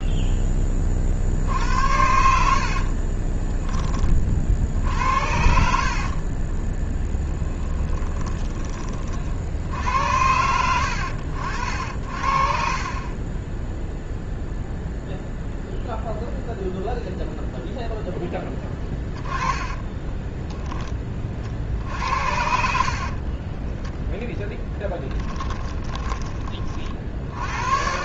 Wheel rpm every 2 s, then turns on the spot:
20, 50, 60, 20, 30, 90, 40, 0, 0, 10, 20, 60, 10, 60.
2-8 18-20 22-24